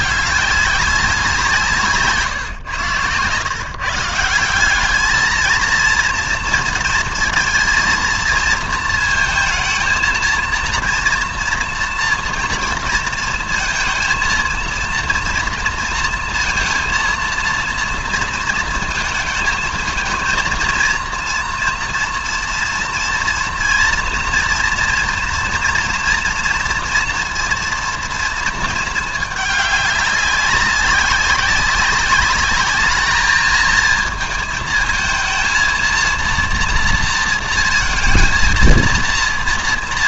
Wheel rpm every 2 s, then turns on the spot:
200, 110, 190, 230, 230, 230, 230, 230, 230, 220, 230, 230, 230, 230, 220, 200, 210, 220, 230, 230.
none